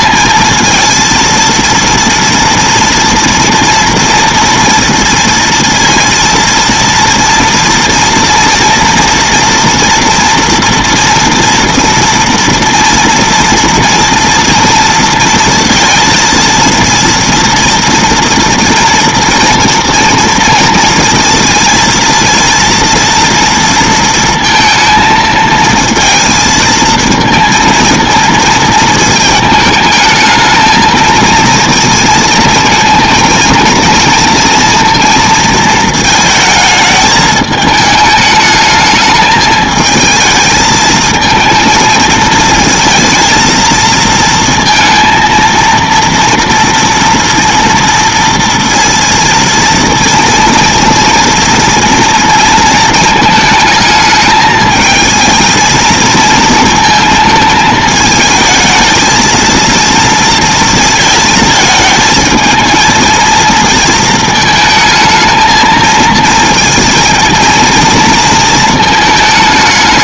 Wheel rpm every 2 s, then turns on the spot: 230, 230, 230, 230, 230, 240, 230, 230, 230, 230, 230, 230, 230, 230, 230, 220, 230, 230, 220, 210, 220, 220, 220, 230, 230, 230, 230, 220, 230, 220, 230, 230, 220, 230, 230.
none